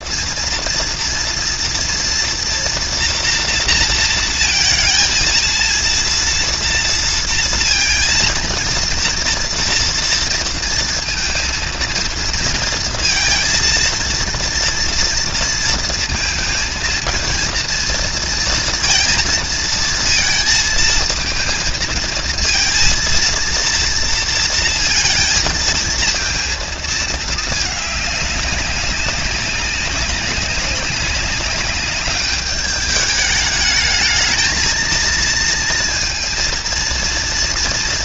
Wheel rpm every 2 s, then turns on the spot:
230, 230, 230, 230, 230, 230, 230, 230, 230, 230, 230, 230, 230, 220, 200, 200, 210, 220, 230.
none